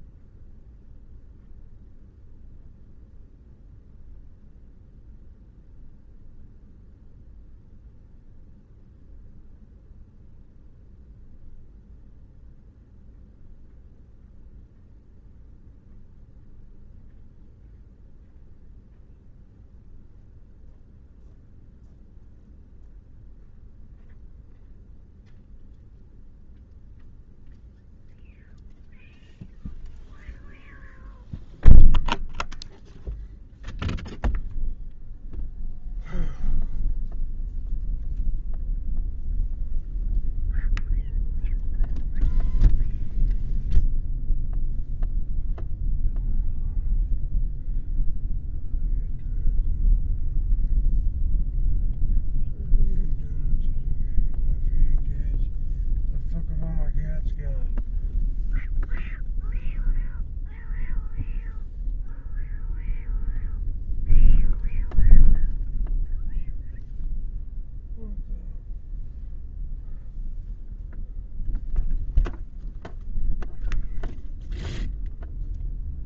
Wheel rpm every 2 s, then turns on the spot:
0, 0, 0, 0, 0, 0, 0, 0, 0, 0, 0, 0, 0, 0, 0, 0, 0, 0, 0, 0, 0, 0, 0, 0, 0, 0, 0, 0, 0, 0, 0, 0, 0, 0, 0, 0, 0, 0.
none